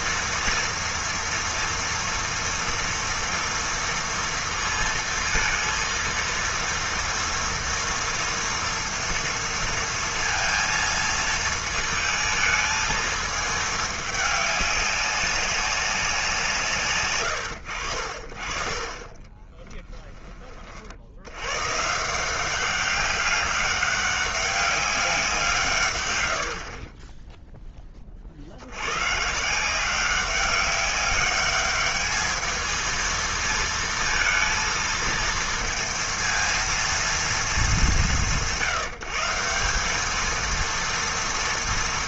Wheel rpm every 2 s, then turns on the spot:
240, 230, 230, 230, 230, 230, 220, 200, 160, 40, 40, 190, 200, 50, 80, 200, 220, 230, 230, 150, 230.
26-28